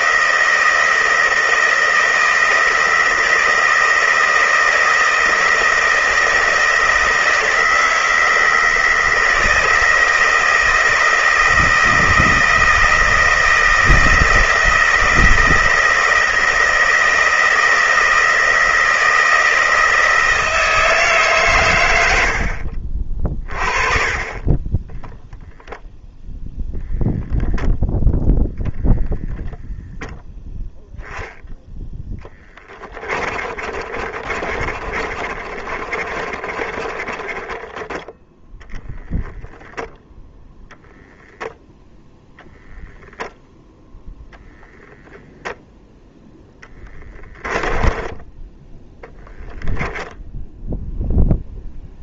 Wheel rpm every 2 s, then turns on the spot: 160, 160, 160, 160, 160, 160, 160, 160, 160, 160, 160, 50, 10, 0, 0, 0, 30, 30, 20, 10, 0, 0, 0, 10, 10, 0.
32-40 46-48